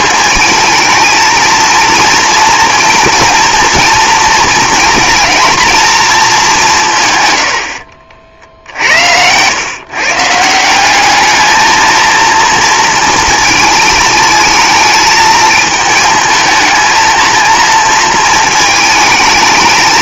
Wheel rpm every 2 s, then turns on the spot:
220, 240, 220, 180, 60, 180, 230, 220, 220, 220.
none